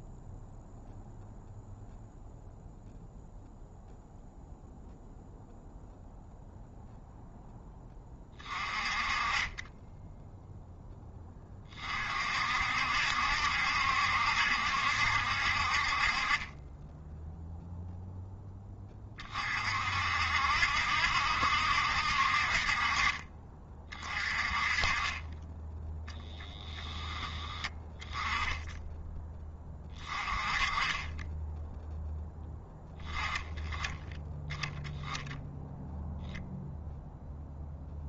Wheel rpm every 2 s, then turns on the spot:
0, 0, 0, 0, 20, 0, 60, 70, 20, 20, 60, 40, 30, 10, 10, 20, 10, 10, 0.
none